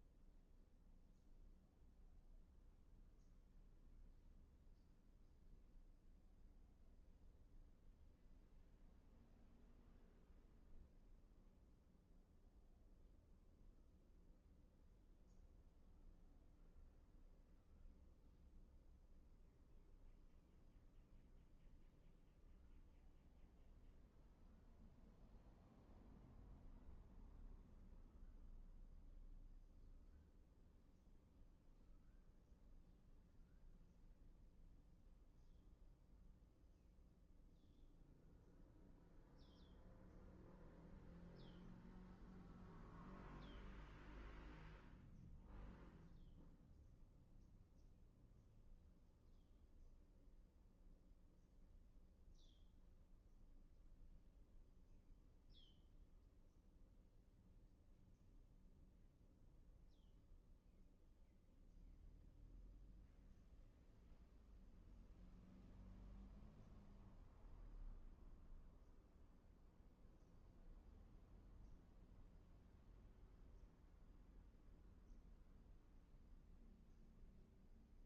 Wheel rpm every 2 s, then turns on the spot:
0, 0, 0, 0, 0, 0, 0, 0, 0, 0, 0, 0, 0, 0, 0, 0, 0, 0, 0, 0, 0, 0, 0, 0, 0, 0, 0, 0, 0, 0, 0, 0, 0, 0, 0, 0, 0, 0, 0.
none